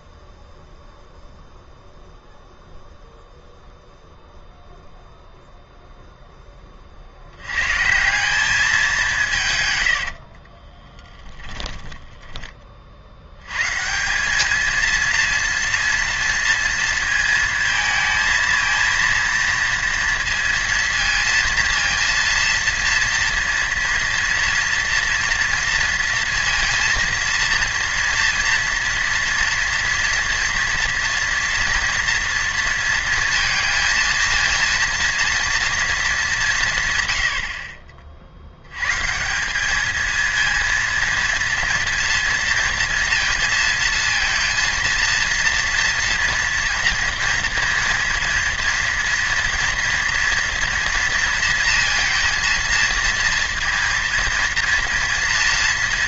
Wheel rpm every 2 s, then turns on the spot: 0, 0, 0, 20, 190, 40, 30, 210, 230, 230, 230, 230, 230, 230, 230, 230, 230, 230, 160, 80, 230, 230, 230, 240, 230, 240, 230, 230.
10-12